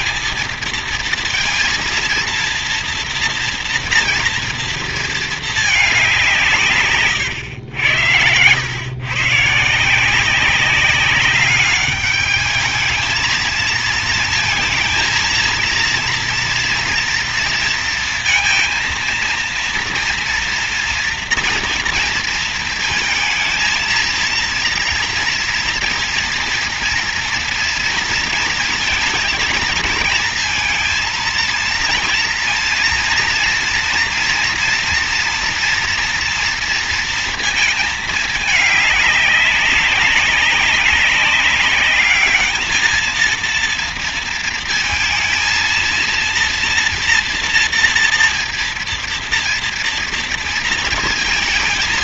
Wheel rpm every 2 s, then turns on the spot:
230, 230, 230, 130, 120, 200, 220, 230, 230, 230, 240, 230, 230, 230, 230, 230, 230, 230, 230, 200, 200, 220, 230, 230, 230, 230.
none